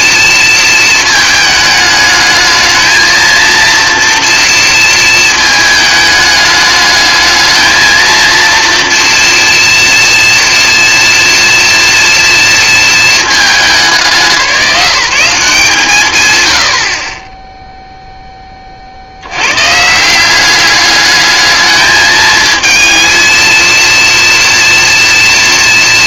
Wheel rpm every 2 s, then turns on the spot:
220, 230, 220, 220, 230, 230, 220, 180, 40, 70, 210, 230, 230.
none